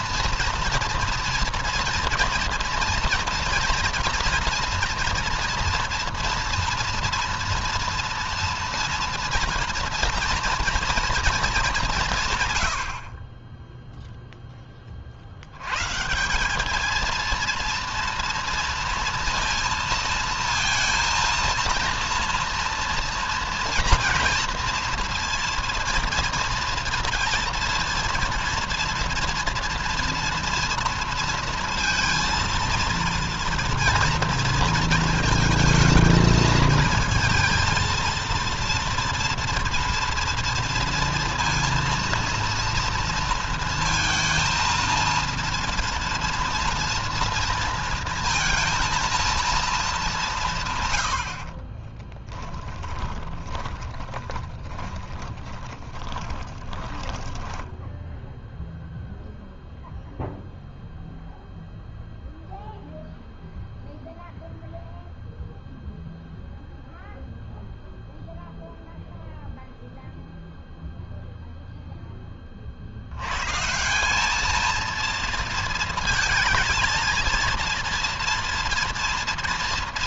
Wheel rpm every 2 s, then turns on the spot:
230, 240, 230, 230, 230, 230, 70, 40, 210, 230, 230, 230, 230, 230, 230, 230, 230, 230, 230, 230, 230, 230, 230, 230, 220, 110, 20, 20, 10, 0, 0, 0, 0, 0, 0, 0, 70, 220, 230, 230.
52-58